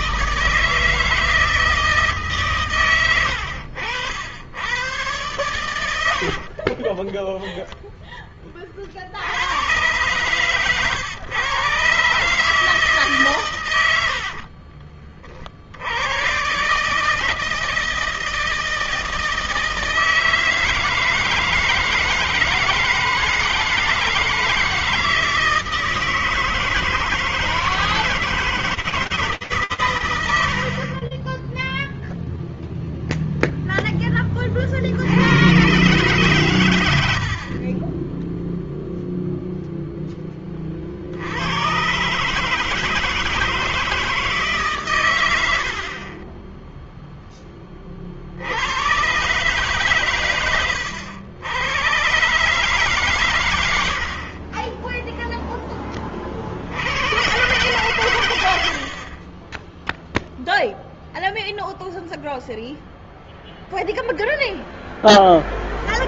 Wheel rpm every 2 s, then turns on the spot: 160, 160, 90, 80, 0, 120, 140, 80, 80, 160, 160, 160, 160, 160, 170, 90, 0, 40, 120, 0, 30, 150, 140, 20, 90, 90, 140, 30, 60, 90, 0, 0, 0.
6-8 14-16 30-32 46-48